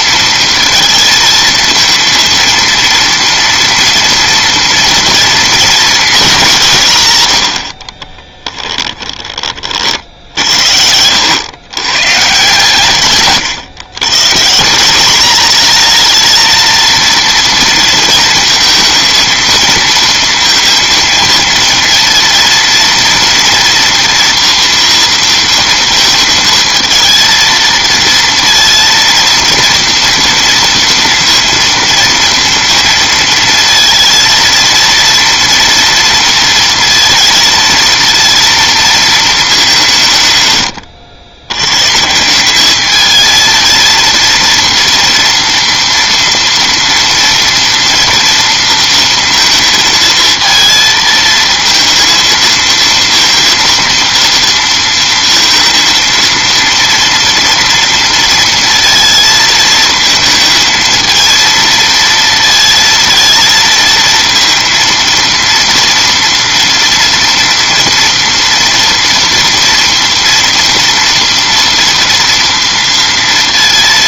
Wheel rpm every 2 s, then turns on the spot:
230, 230, 240, 170, 10, 70, 140, 180, 230, 230, 230, 230, 230, 220, 230, 230, 230, 230, 230, 230, 110, 210, 230, 230, 230, 230, 230, 230, 230, 230, 220, 230, 230, 230, 230, 230, 230.
8-10